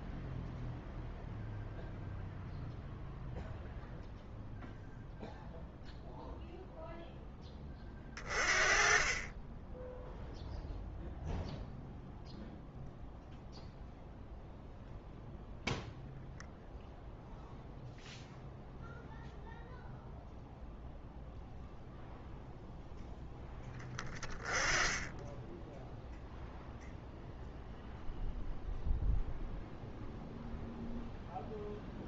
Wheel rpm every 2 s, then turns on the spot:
0, 0, 0, 0, 40, 0, 0, 0, 0, 0, 0, 0, 10, 0, 0, 0.
none